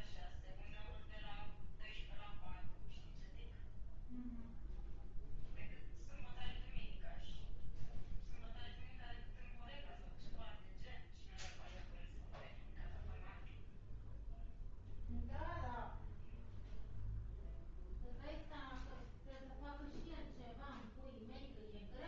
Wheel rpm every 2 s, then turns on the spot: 0, 0, 0, 0, 0, 0, 0, 0, 0, 0, 0.
none